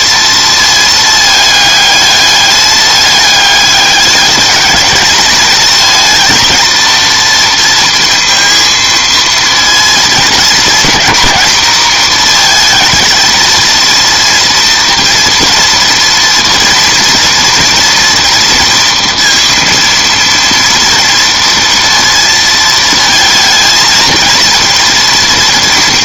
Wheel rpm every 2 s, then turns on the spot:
230, 210, 210, 220, 230, 220, 220, 230, 230, 230, 230, 220, 230.
none